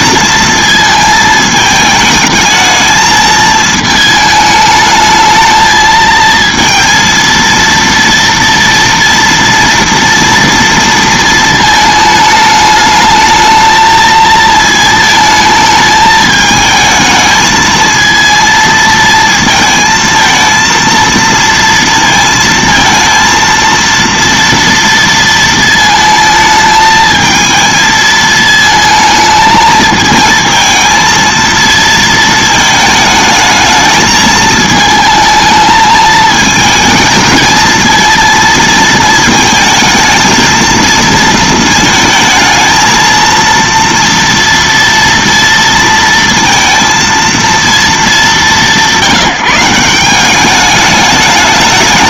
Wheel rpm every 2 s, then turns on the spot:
220, 220, 210, 230, 230, 230, 210, 220, 220, 230, 230, 230, 230, 220, 220, 230, 220, 220, 220, 230, 230, 220, 230, 230, 160, 200.
none